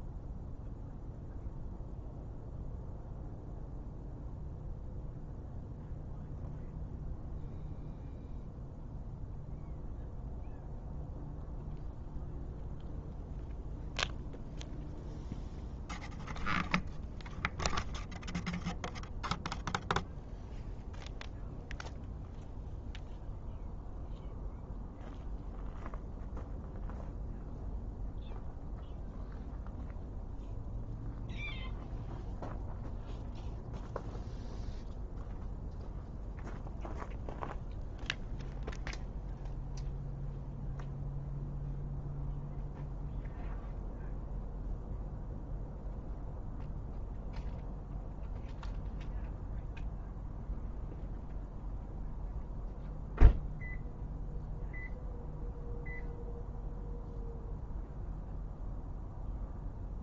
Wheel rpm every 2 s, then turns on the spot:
0, 0, 0, 0, 0, 0, 0, 0, 0, 0, 0, 0, 0, 0, 0, 0, 0, 0, 0, 0, 0, 0, 0, 0, 0, 0, 0, 0, 0, 0.
none